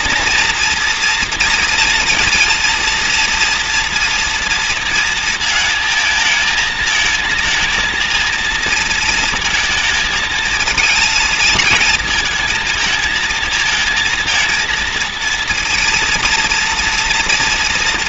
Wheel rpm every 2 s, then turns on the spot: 230, 230, 230, 220, 220, 230, 220, 230, 230.
none